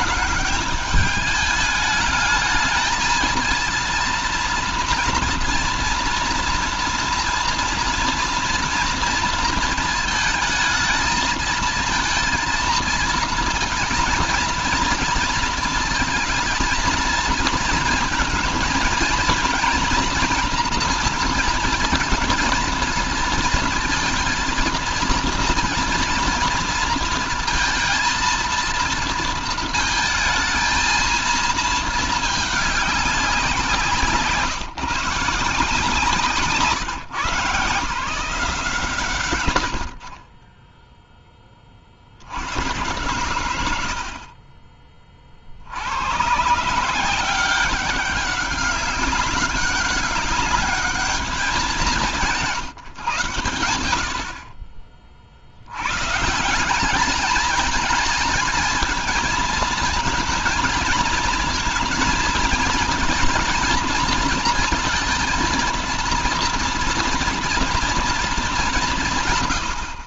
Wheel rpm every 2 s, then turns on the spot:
210, 220, 230, 230, 230, 220, 230, 230, 220, 230, 230, 220, 220, 230, 230, 220, 200, 150, 150, 140, 10, 110, 40, 160, 200, 210, 150, 40, 180, 220, 220, 230, 230, 230, 200.
none